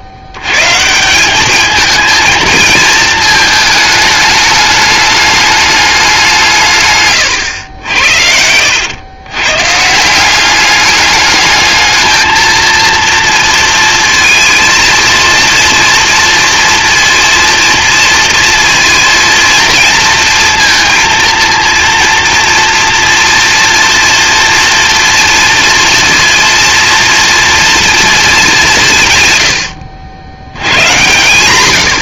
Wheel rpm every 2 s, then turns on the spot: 80, 220, 210, 150, 80, 200, 230, 230, 230, 230, 230, 230, 230, 230, 190, 110.
none